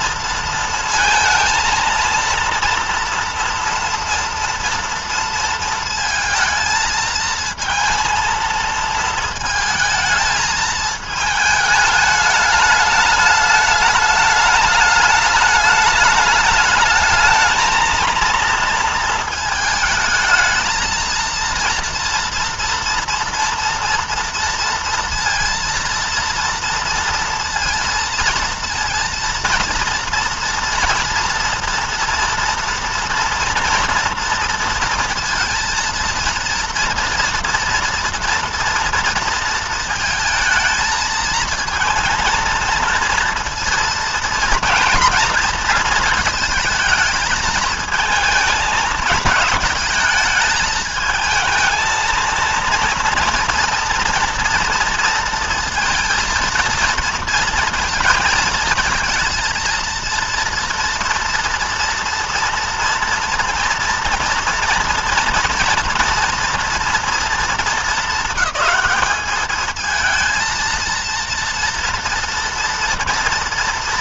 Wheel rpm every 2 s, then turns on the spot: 230, 230, 230, 220, 230, 220, 210, 210, 210, 230, 220, 230, 230, 230, 230, 230, 230, 230, 230, 230, 220, 230, 230, 220, 220, 210, 230, 240, 230, 230, 230, 230, 230, 230, 220, 230, 230.
none